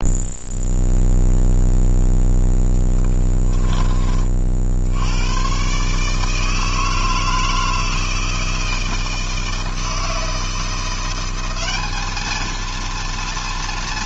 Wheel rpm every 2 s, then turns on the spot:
0, 10, 70, 160, 160, 180, 230.
2-4